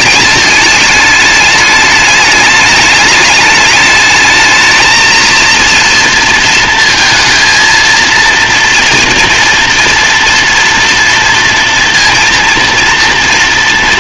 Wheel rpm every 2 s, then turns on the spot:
210, 210, 210, 230, 230, 230, 230.
none